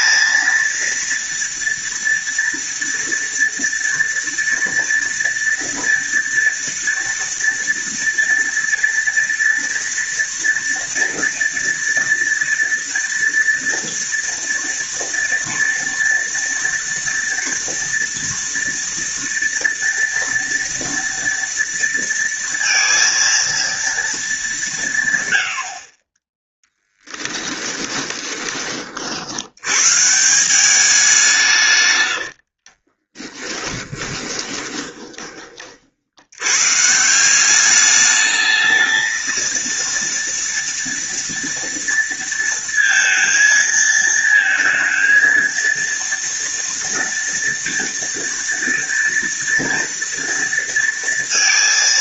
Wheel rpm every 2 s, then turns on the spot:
230, 230, 230, 230, 230, 230, 230, 230, 230, 230, 230, 230, 150, 10, 50, 190, 30, 20, 150, 220, 240, 230, 230, 230, 230, 210.
32-36